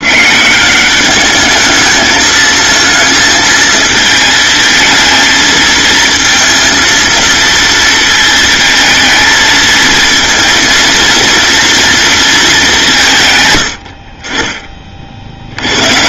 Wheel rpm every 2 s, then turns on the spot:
200, 220, 220, 230, 220, 230, 160, 40.
none